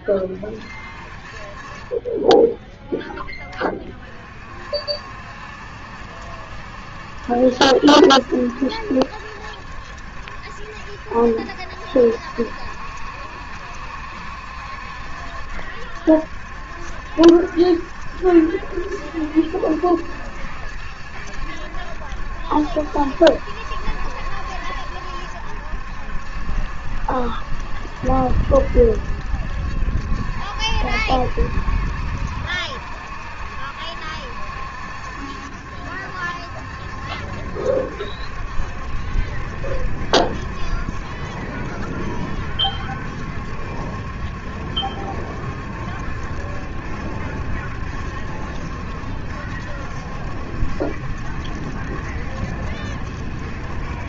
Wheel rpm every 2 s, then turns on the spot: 30, 10, 50, 70, 70, 70, 60, 70, 70, 70, 70, 70, 70, 70, 70, 60, 60, 70, 70, 70, 70, 70, 70, 70, 70, 70, 70.
none